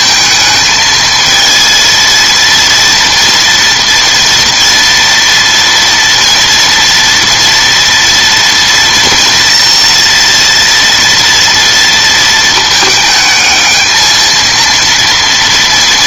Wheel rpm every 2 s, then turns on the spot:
220, 230, 230, 230, 230, 230, 220, 230.
none